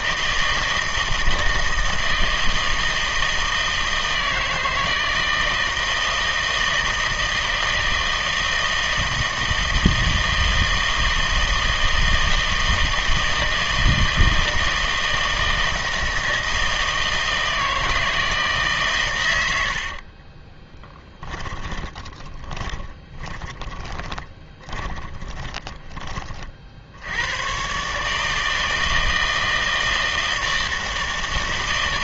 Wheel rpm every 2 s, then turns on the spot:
160, 160, 160, 160, 160, 160, 160, 160, 160, 150, 20, 20, 20, 40, 160, 160.
20-26